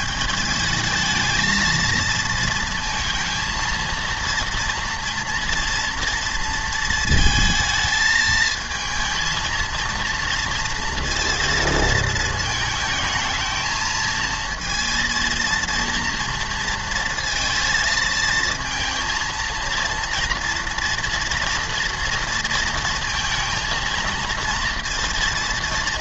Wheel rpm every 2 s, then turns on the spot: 210, 230, 230, 230, 220, 230, 220, 230, 230, 230, 230, 230, 230.
none